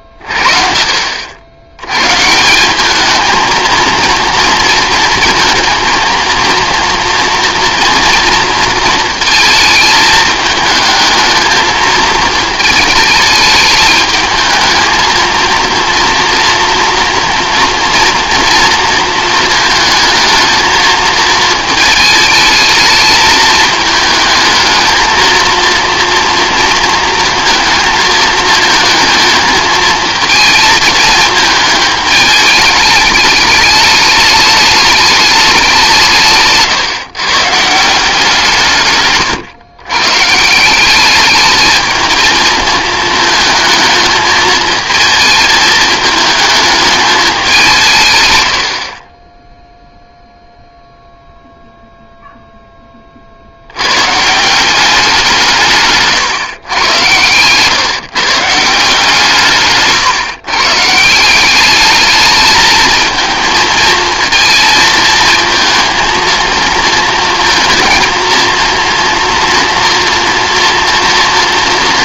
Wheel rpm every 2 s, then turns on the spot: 50, 170, 230, 230, 230, 220, 220, 220, 230, 230, 220, 220, 220, 230, 220, 220, 210, 210, 160, 170, 160, 220, 220, 220, 100, 0, 10, 190, 110, 160, 150, 220, 220, 230, 230, 230.
36-38